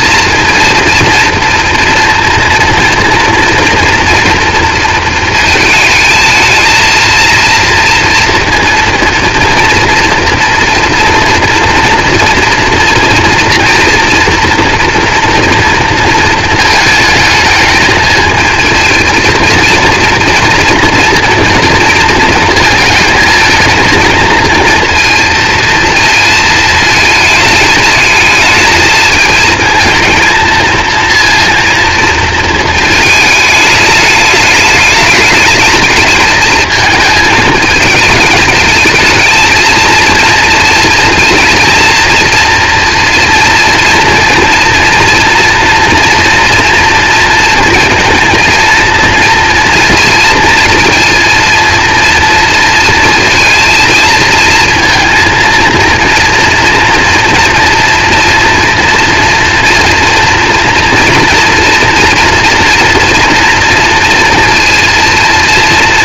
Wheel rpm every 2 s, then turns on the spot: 230, 230, 230, 220, 230, 240, 230, 240, 220, 230, 240, 220, 230, 220, 220, 230, 220, 210, 220, 220, 230, 230, 230, 230, 230, 230, 230, 230, 230, 240, 230, 230, 230.
none